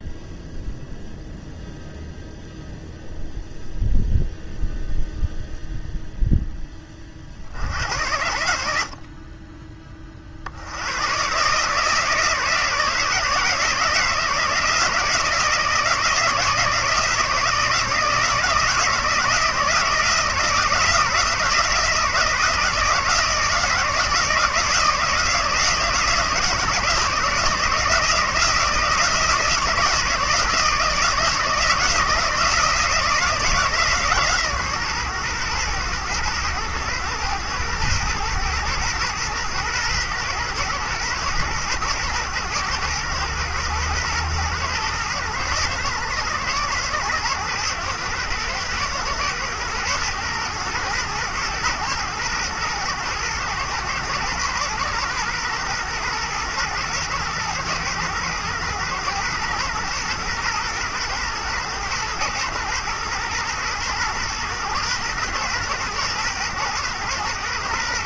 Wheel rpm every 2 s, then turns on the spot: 0, 0, 0, 10, 60, 70, 160, 160, 160, 160, 170, 160, 160, 160, 160, 160, 160, 130, 110, 120, 110, 110, 110, 110, 110, 110, 110, 120, 110, 110, 110, 110, 120, 120.
none